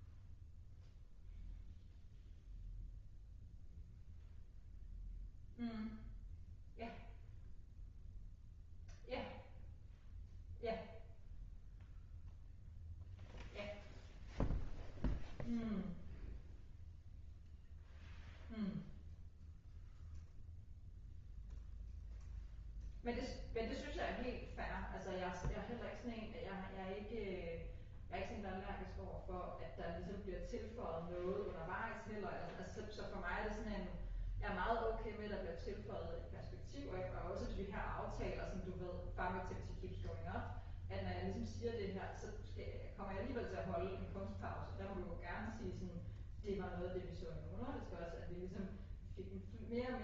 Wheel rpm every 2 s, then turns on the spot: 0, 0, 0, 0, 0, 0, 0, 0, 0, 0, 0, 0, 0, 0, 0, 0, 0, 0, 0, 0, 0, 0, 0, 0, 0.
none